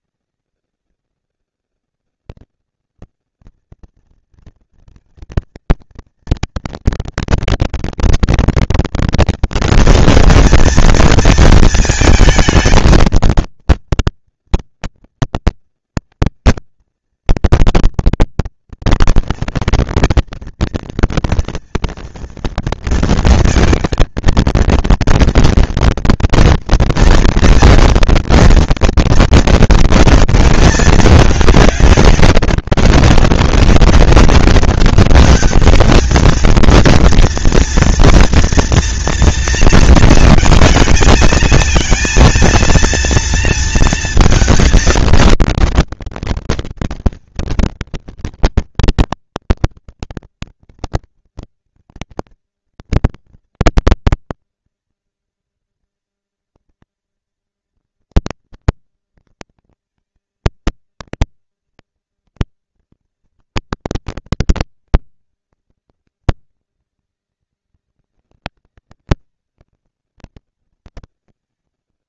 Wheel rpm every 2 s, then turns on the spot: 200, 220, 230, 230, 230, 230, 220, 230, 230, 230, 230, 230, 220, 230, 240, 220, 200, 200, 220, 230, 220, 230, 230, 230, 230, 240, 230, 230, 230, 230, 230, 230, 230, 190, 200, 210.
none